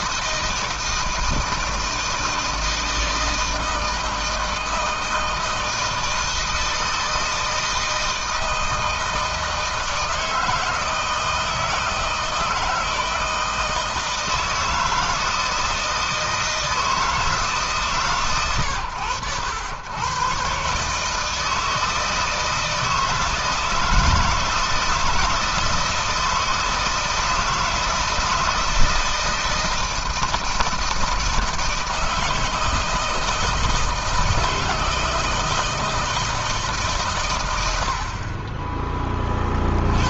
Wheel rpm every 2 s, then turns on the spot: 160, 160, 160, 160, 160, 160, 160, 160, 150, 100, 150, 160, 160, 160, 160, 160, 160, 160, 120, 40.
none